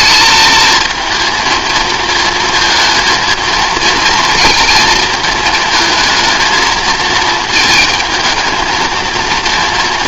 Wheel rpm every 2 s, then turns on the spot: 220, 220, 220, 220, 220.
none